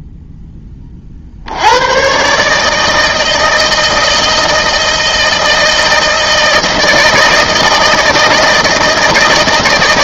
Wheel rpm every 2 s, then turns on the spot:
40, 160, 160, 160, 160.
none